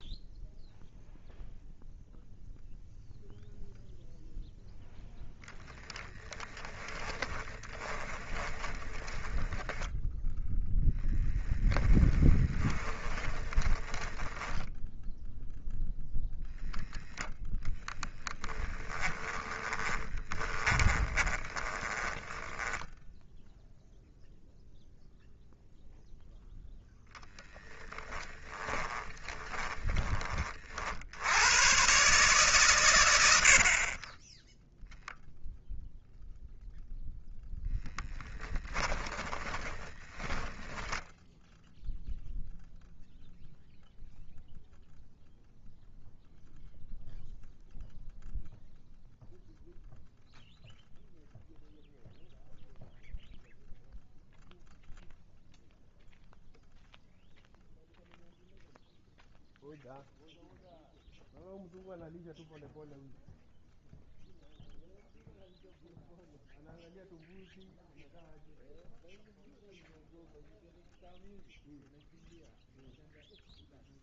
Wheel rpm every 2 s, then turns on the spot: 0, 0, 10, 30, 20, 0, 20, 10, 0, 10, 20, 10, 0, 0, 10, 60, 120, 0, 0, 20, 10, 0, 0, 0, 0, 0, 0, 0, 0, 0, 0, 0, 0, 0, 0, 0, 0.
6-10 12-16 18-24 28-30 38-42